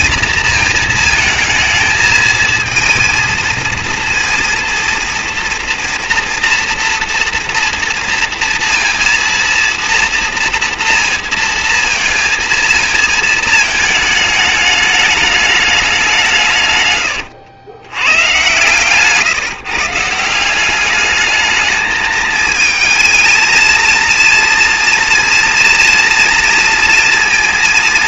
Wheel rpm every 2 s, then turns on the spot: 230, 220, 230, 230, 230, 230, 230, 220, 190, 110, 160, 210, 230, 230.
none